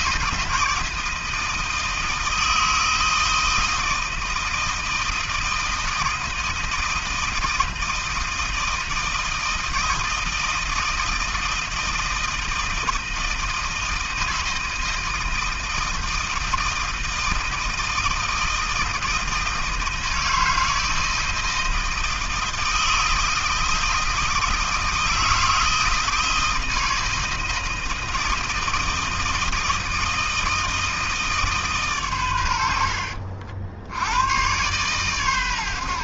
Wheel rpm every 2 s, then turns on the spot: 160, 160, 160, 160, 160, 160, 160, 160, 160, 160, 160, 160, 160, 160, 160, 160, 80, 120.
none